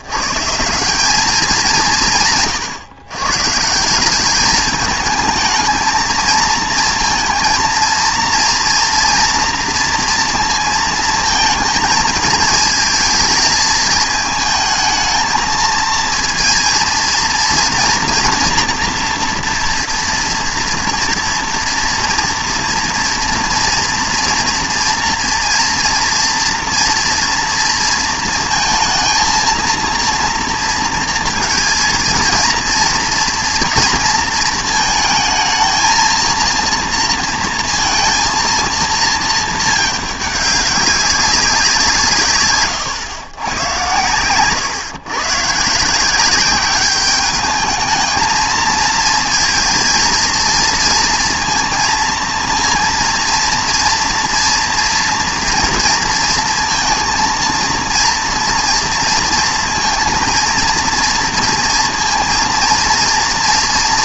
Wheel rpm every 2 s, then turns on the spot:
180, 140, 210, 230, 230, 230, 220, 220, 230, 230, 230, 230, 230, 230, 230, 230, 230, 230, 230, 230, 200, 120, 130, 200, 230, 230, 230, 230, 230, 230, 230, 230.
42-44